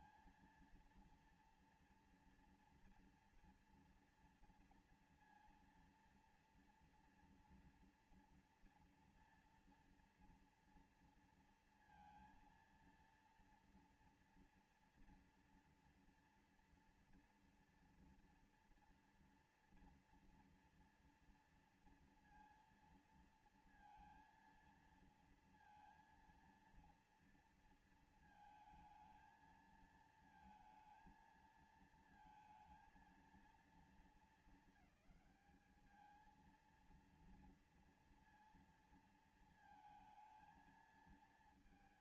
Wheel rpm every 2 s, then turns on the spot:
230, 230, 230, 230, 240, 230, 230, 230, 230, 240, 230, 230, 230, 230, 230, 220, 230, 230, 210, 230, 220.
none